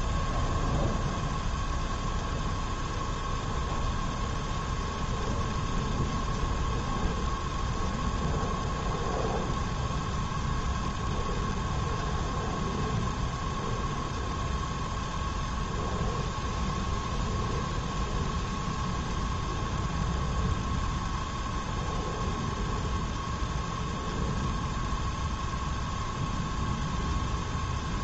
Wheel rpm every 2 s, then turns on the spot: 0, 0, 0, 0, 0, 0, 0, 0, 0, 0, 0, 0, 0, 0.
none